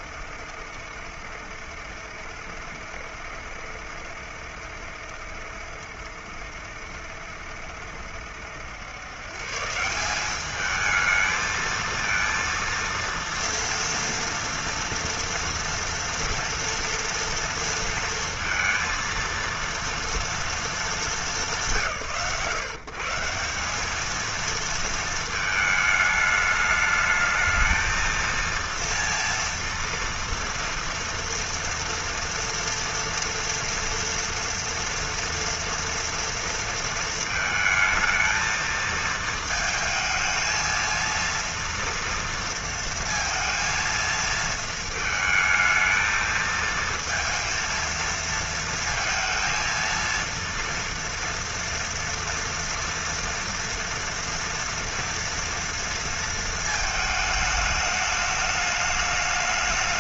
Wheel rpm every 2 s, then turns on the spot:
70, 70, 70, 70, 70, 200, 230, 230, 230, 230, 230, 130, 230, 210, 230, 230, 230, 230, 230, 220, 220, 230, 220, 220, 230, 230, 230, 230, 230, 210.
none